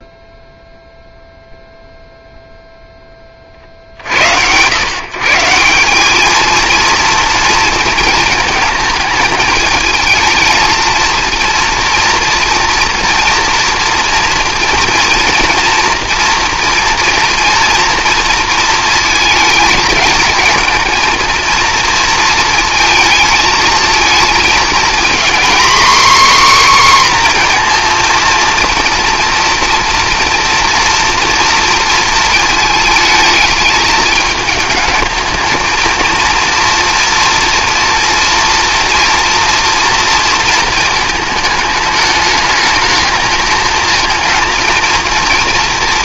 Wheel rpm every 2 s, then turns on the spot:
0, 10, 130, 230, 220, 230, 240, 230, 240, 230, 230, 220, 240, 260, 230, 240, 220, 220, 230, 240, 220, 210, 230.
none